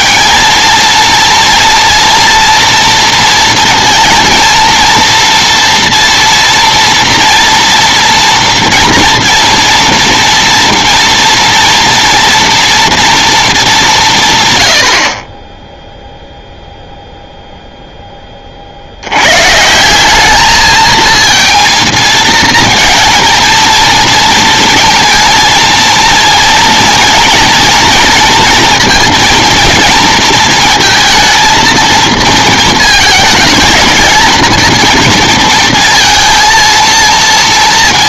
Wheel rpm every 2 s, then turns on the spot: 220, 230, 230, 240, 230, 230, 230, 120, 0, 40, 220, 230, 230, 230, 230, 220, 220, 230, 230.
none